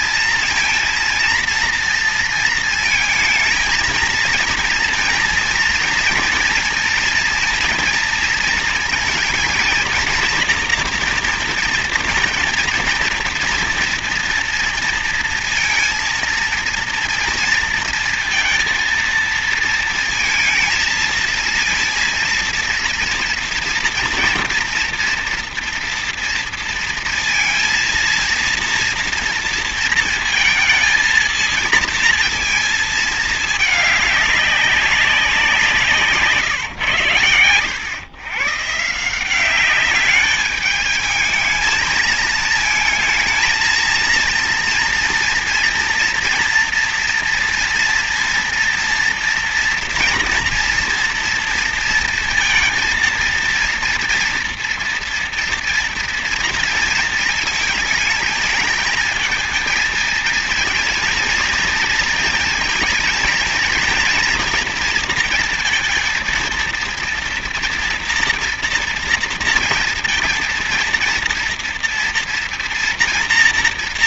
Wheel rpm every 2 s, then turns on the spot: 230, 230, 230, 230, 230, 230, 230, 230, 230, 230, 230, 230, 230, 230, 230, 230, 230, 200, 150, 140, 210, 220, 230, 230, 230, 230, 230, 230, 230, 220, 230, 230, 230, 230, 230, 230, 240.
none